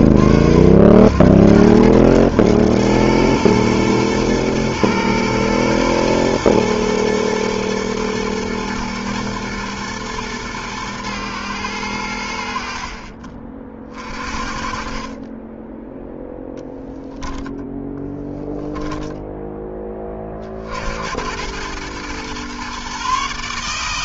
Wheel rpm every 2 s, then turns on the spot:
90, 110, 110, 110, 110, 110, 50, 30, 10, 10, 80, 140.
18-20